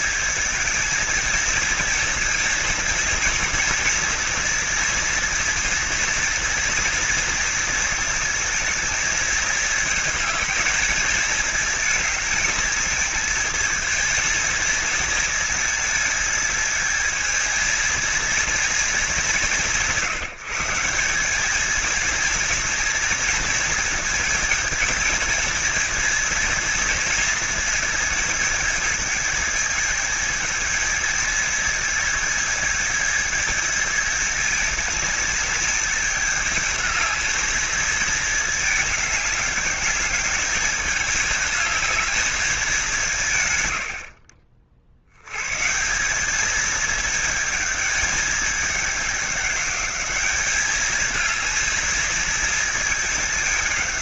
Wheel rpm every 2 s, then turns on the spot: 220, 230, 230, 230, 220, 220, 220, 230, 220, 220, 190, 230, 230, 230, 220, 220, 220, 220, 220, 210, 210, 180, 60, 210, 200, 210, 220.
none